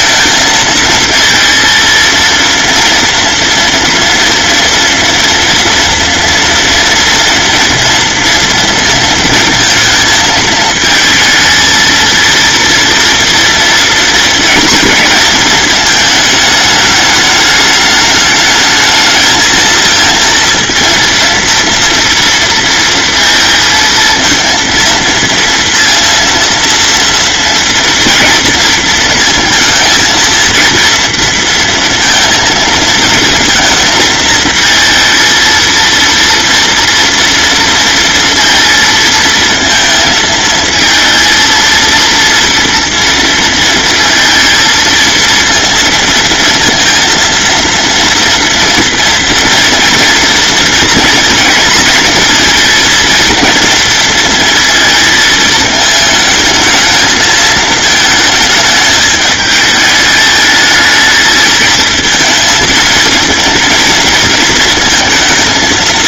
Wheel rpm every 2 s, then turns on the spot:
230, 240, 230, 230, 230, 230, 230, 230, 210, 220, 230, 230, 230, 230, 230, 230, 220, 220, 230, 230, 230, 230, 230, 230, 230, 230, 230, 220, 220, 220, 220, 230, 230.
none